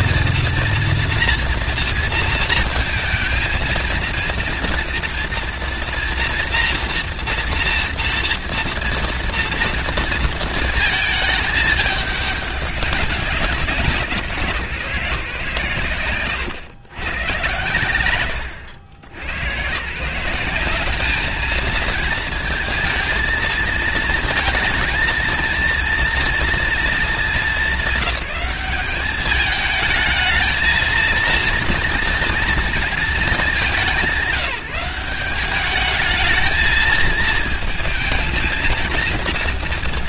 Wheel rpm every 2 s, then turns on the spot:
230, 230, 230, 230, 240, 230, 200, 140, 120, 90, 190, 230, 230, 230, 200, 220, 230, 190, 220, 230.
none